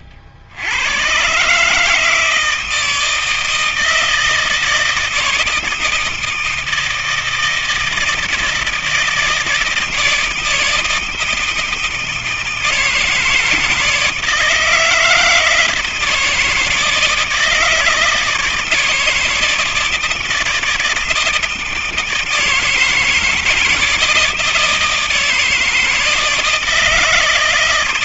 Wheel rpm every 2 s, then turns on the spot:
80, 160, 160, 160, 170, 160, 160, 160, 160, 160, 160, 160, 160, 160.
none